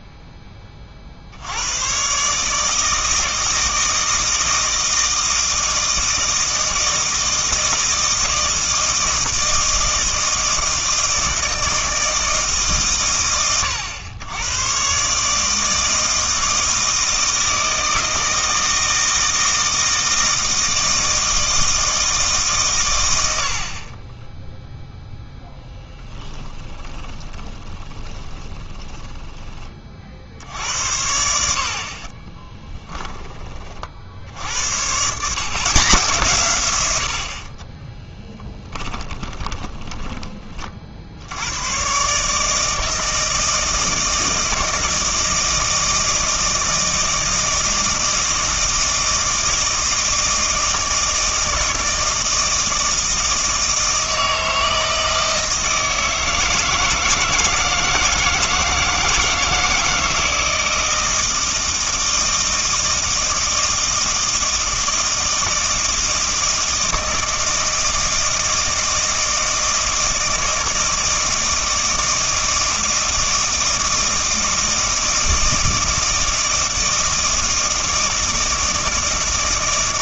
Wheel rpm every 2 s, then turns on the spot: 30, 160, 160, 160, 160, 160, 140, 120, 160, 160, 160, 130, 0, 20, 20, 90, 20, 110, 90, 10, 60, 160, 160, 160, 160, 160, 160, 160, 160, 160, 160, 160, 160, 160, 160, 160, 160, 160, 160, 160.
26-30 32-34 38-40